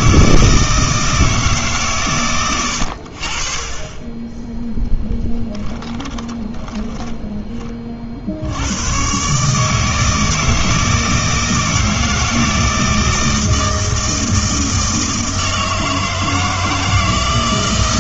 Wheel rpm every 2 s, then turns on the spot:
160, 90, 10, 20, 100, 160, 160, 160, 160.
6-8